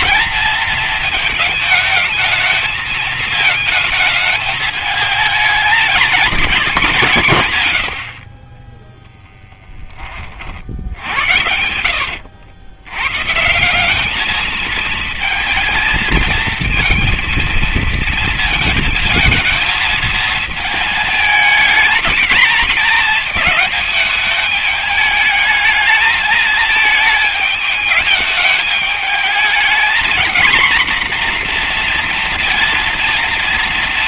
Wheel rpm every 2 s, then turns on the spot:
230, 220, 220, 180, 10, 60, 110, 220, 230, 220, 220, 210, 210, 220, 210, 240, 230.
10-12